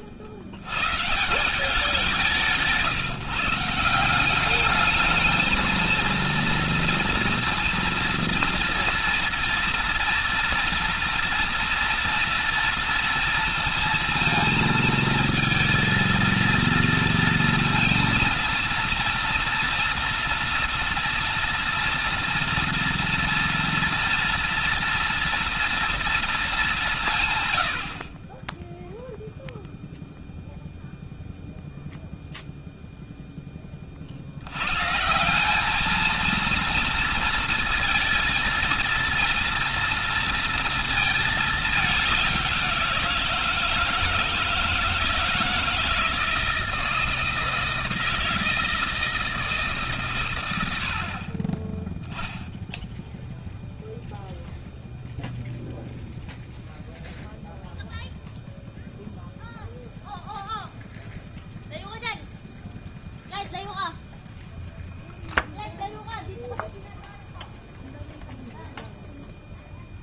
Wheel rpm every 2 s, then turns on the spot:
160, 150, 220, 230, 230, 230, 230, 230, 230, 230, 240, 230, 230, 140, 0, 0, 10, 190, 230, 230, 220, 170, 160, 160, 160, 60, 0, 0, 0, 0, 0, 0, 0, 0, 0.
none